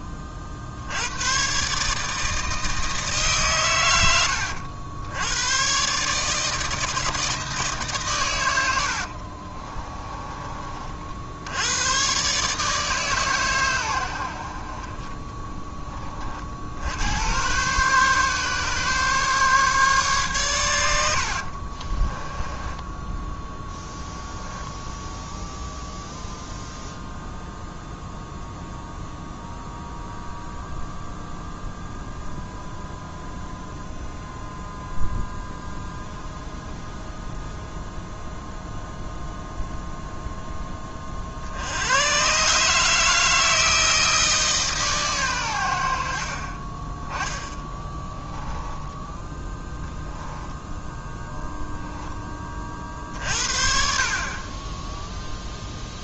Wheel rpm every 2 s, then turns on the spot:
70, 160, 80, 160, 100, 40, 150, 50, 60, 140, 130, 10, 10, 0, 0, 0, 0, 0, 0, 0, 10, 150, 150, 20, 10, 0, 30, 20.
22-26 48-50